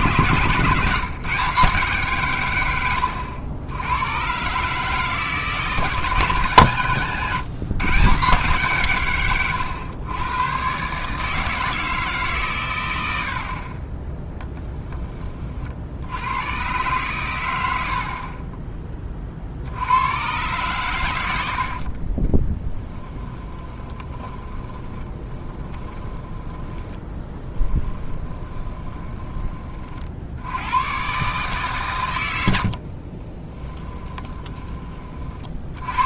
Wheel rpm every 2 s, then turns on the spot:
150, 100, 150, 140, 140, 130, 110, 10, 110, 10, 130, 10, 20, 10, 20, 110, 50, 20.
2-4 22-30 32-34